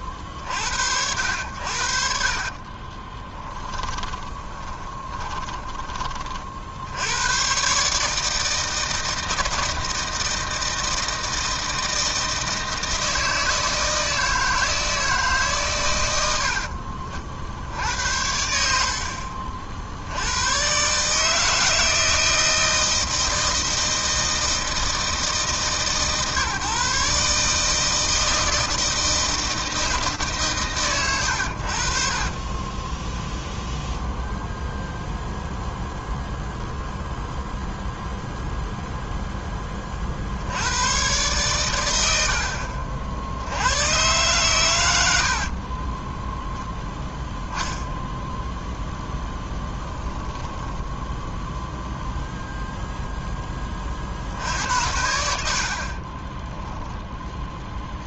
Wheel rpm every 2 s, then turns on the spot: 50, 50, 20, 60, 160, 160, 160, 160, 70, 70, 120, 160, 160, 140, 160, 120, 10, 0, 0, 0, 120, 70, 100, 0, 0, 0, 10, 80, 0.
2-6 32-34